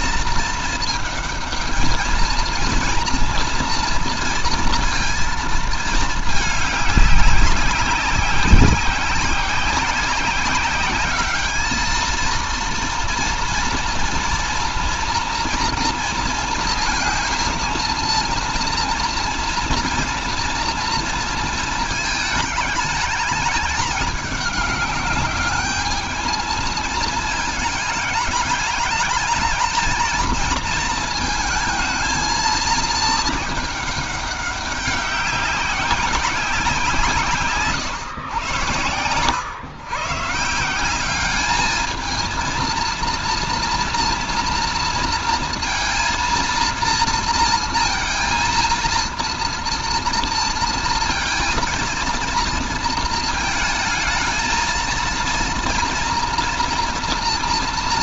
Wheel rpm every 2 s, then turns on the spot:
220, 230, 230, 200, 190, 200, 230, 240, 230, 230, 230, 210, 200, 220, 210, 230, 220, 200, 170, 100, 170, 220, 230, 230, 230, 230, 230, 230, 230.
38-40